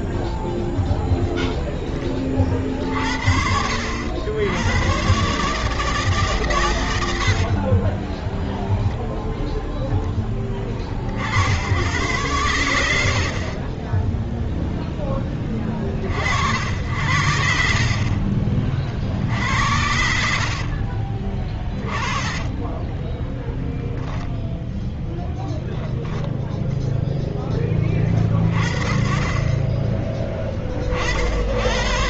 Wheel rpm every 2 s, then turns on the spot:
0, 60, 110, 100, 0, 30, 90, 0, 70, 50, 50, 30, 0, 0, 30, 40.
20-24